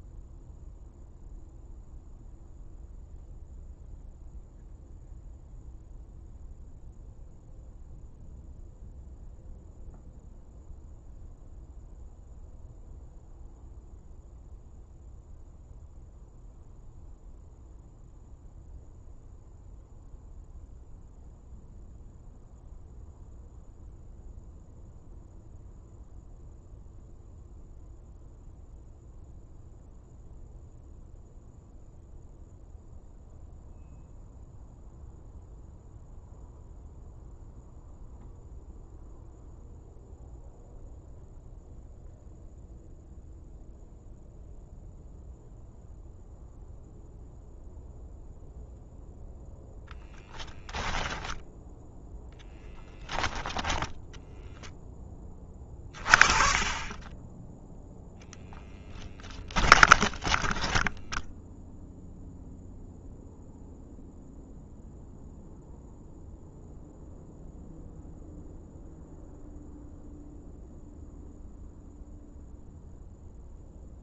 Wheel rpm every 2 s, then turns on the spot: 0, 0, 0, 0, 0, 0, 0, 0, 0, 0, 0, 0, 0, 0, 0, 0, 0, 0, 0, 0, 0, 0, 0, 0, 0, 0, 10, 10, 30, 10, 10, 0, 0, 0, 0, 0, 0.
58-62